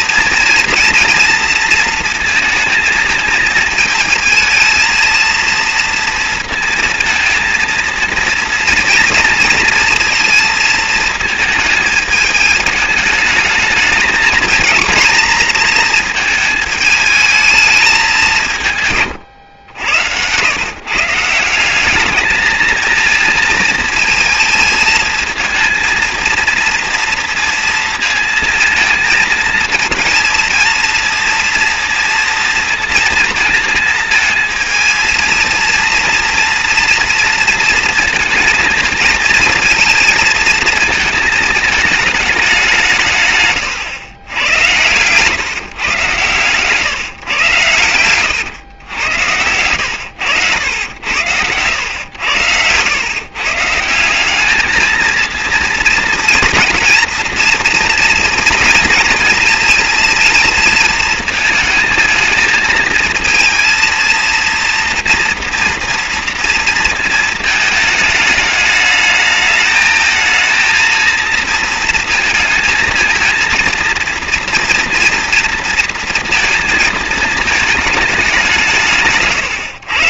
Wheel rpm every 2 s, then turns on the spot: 230, 230, 230, 230, 230, 230, 210, 220, 220, 160, 120, 220, 220, 230, 220, 230, 230, 220, 230, 220, 220, 200, 100, 140, 110, 100, 100, 210, 230, 230, 230, 220, 230, 230, 210, 230, 230, 230, 230, 190.
none